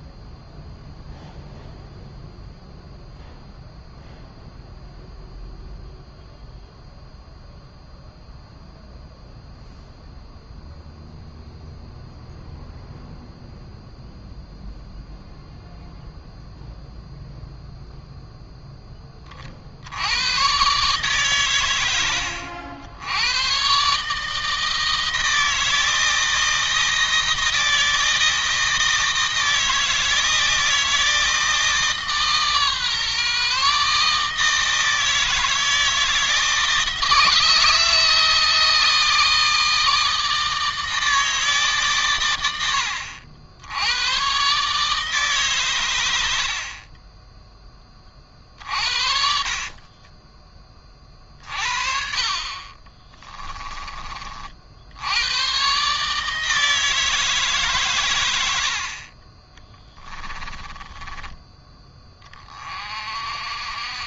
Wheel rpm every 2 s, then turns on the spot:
0, 0, 0, 0, 0, 0, 0, 0, 0, 20, 120, 80, 160, 160, 160, 160, 140, 160, 160, 160, 160, 70, 140, 30, 40, 20, 30, 70, 160, 50, 20, 40.
46-50 52-54 58-62